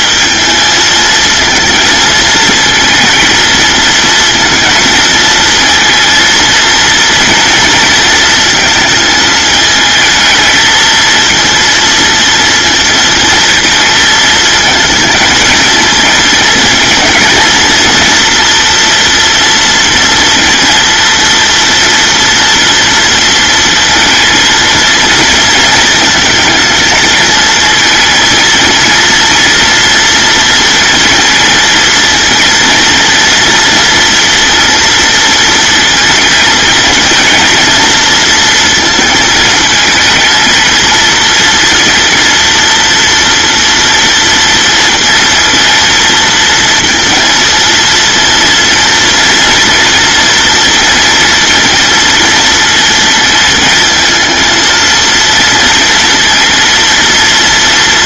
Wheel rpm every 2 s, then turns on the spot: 220, 230, 220, 230, 220, 230, 230, 220, 220, 230, 230, 230, 230, 220, 230, 230, 230, 230, 230, 230, 230, 230, 230, 230, 240, 230, 220, 230, 230.
none